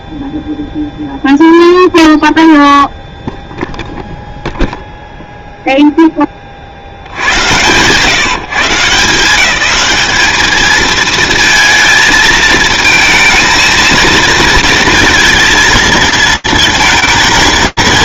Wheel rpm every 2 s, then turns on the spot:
0, 0, 0, 50, 150, 220, 220, 230, 230.
none